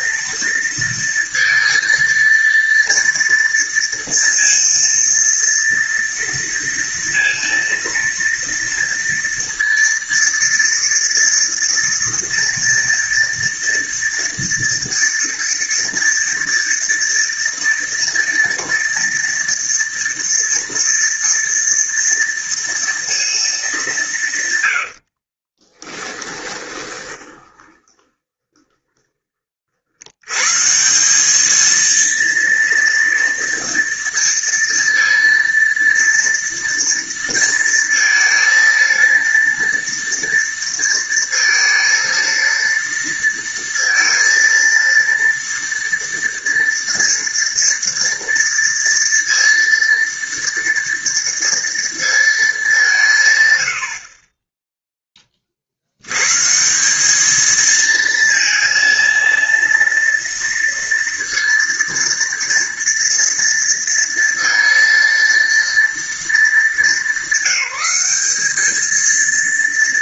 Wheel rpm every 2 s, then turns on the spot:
230, 230, 230, 230, 230, 230, 230, 230, 230, 230, 230, 230, 100, 20, 20, 160, 230, 230, 230, 230, 230, 230, 230, 230, 230, 230, 190, 10, 180, 230, 230, 230, 230, 210, 220.
24-30